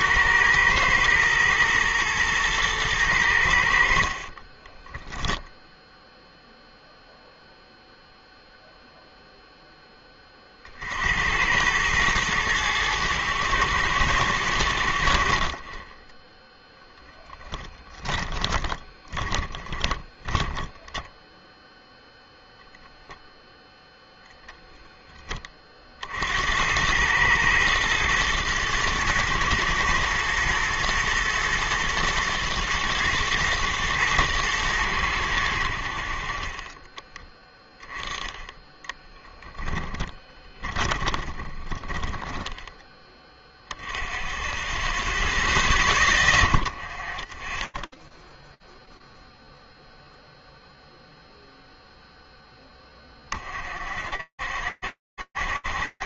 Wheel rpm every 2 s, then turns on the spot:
110, 110, 10, 0, 0, 50, 110, 90, 10, 20, 10, 0, 10, 90, 110, 120, 110, 110, 20, 10, 20, 10, 10, 10, 0, 0, 20, 70.
4-6 18-22 40-42